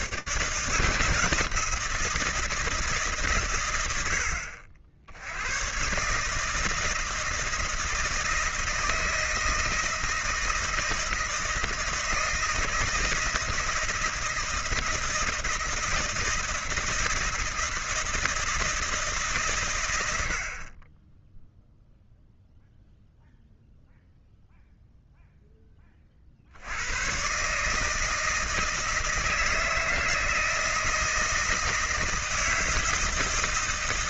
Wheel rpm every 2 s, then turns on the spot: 150, 160, 60, 160, 160, 160, 160, 160, 160, 160, 20, 0, 0, 120, 160, 160, 160.
none